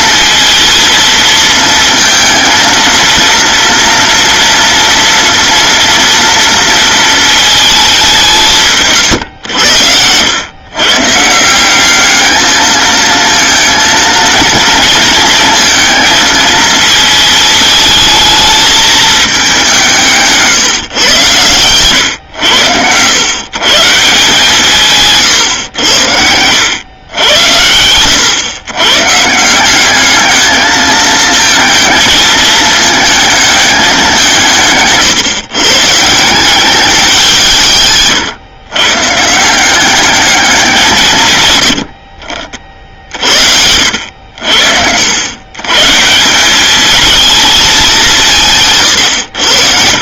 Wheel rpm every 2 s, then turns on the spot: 230, 230, 230, 230, 150, 120, 220, 230, 220, 220, 140, 90, 160, 110, 120, 220, 220, 150, 190, 130, 200, 50, 80, 210, 140.
none